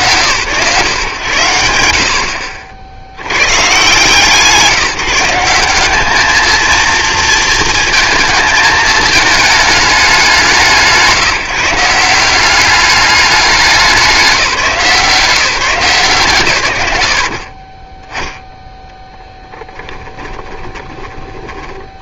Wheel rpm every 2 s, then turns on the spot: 120, 60, 170, 230, 220, 170, 190, 170, 100, 0, 20.
20-22